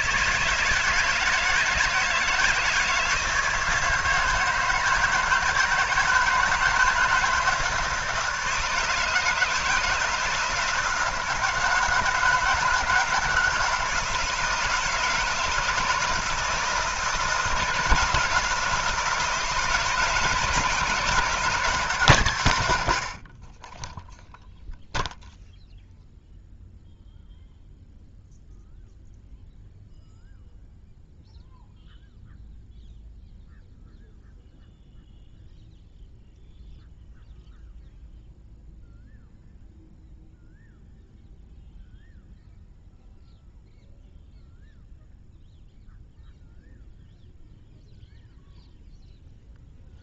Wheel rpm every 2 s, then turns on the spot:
150, 160, 160, 160, 160, 160, 160, 160, 160, 170, 160, 110, 0, 0, 0, 0, 0, 0, 0, 0, 0, 0, 0, 0, 0.
none